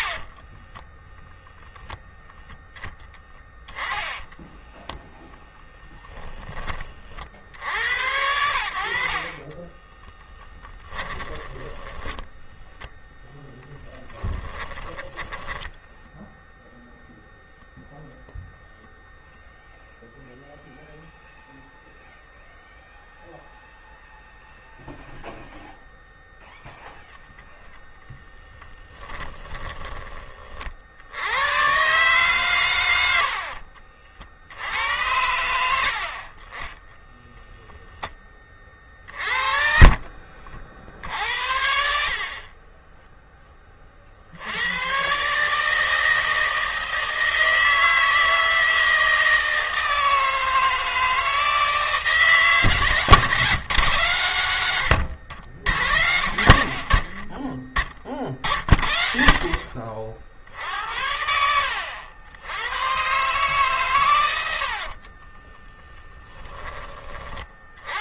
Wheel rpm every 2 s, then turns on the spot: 10, 10, 10, 40, 60, 10, 0, 10, 0, 0, 0, 0, 0, 0, 10, 60, 90, 80, 10, 30, 60, 20, 130, 160, 160, 160, 150, 90, 40, 50, 70, 120, 50, 30.
0-6 10-12 14-16 28-30 36-40 54-58 64-66